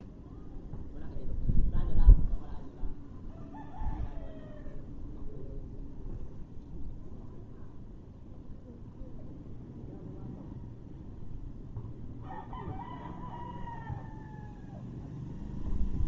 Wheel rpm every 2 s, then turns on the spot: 0, 0, 0, 0, 0, 0, 0, 0.
none